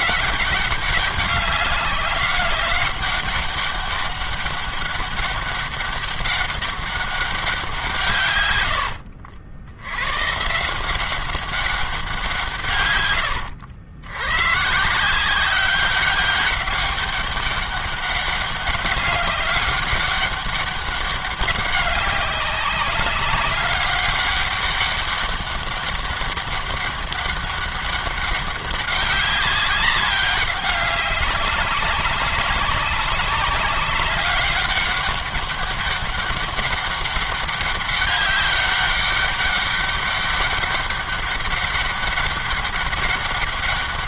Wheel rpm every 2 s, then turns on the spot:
200, 200, 200, 200, 90, 170, 140, 160, 200, 200, 200, 200, 200, 200, 190, 190, 200, 200, 200, 200, 200, 200.
8-10